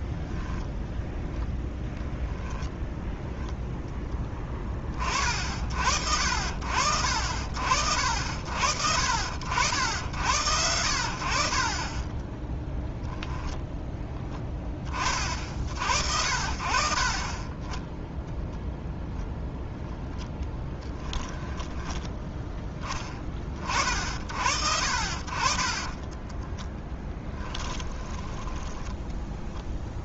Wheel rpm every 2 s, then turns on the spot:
0, 10, 20, 60, 60, 80, 10, 20, 50, 0, 10, 10, 60, 20, 10.
2-4 12-14 20-22 26-30